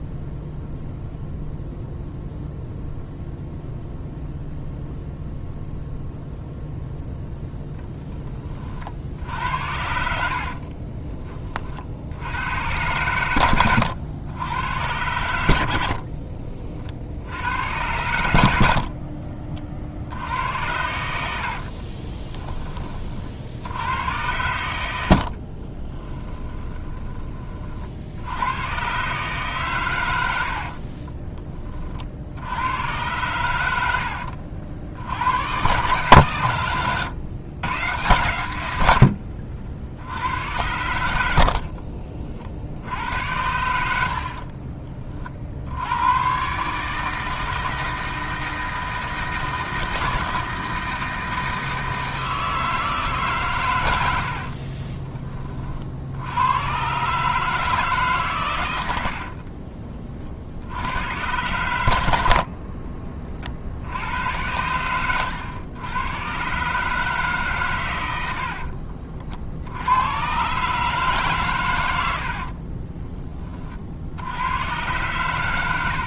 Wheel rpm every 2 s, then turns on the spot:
0, 0, 0, 0, 40, 40, 100, 100, 50, 40, 90, 20, 80, 10, 120, 50, 90, 60, 110, 100, 90, 80, 30, 150, 160, 160, 160, 40, 110, 100, 80, 40, 100, 140, 50, 150, 30, 120.
10-12 20-22 30-32 36-38 44-46 54-56 62-64 68-70 72-74